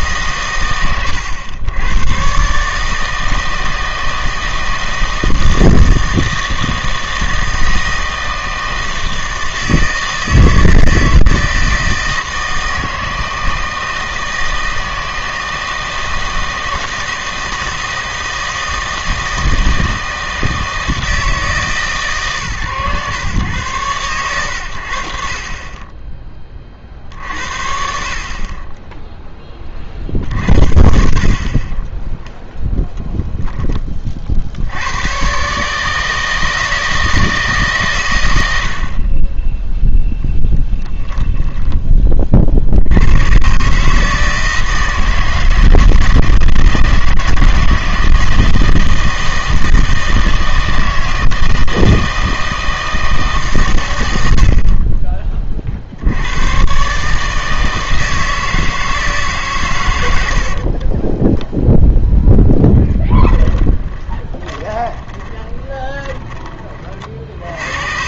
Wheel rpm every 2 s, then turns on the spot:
120, 150, 160, 160, 160, 160, 160, 160, 160, 160, 160, 120, 90, 40, 10, 50, 0, 90, 160, 60, 10, 70, 160, 170, 160, 160, 160, 40, 130, 160, 50, 20, 20, 30.
60-66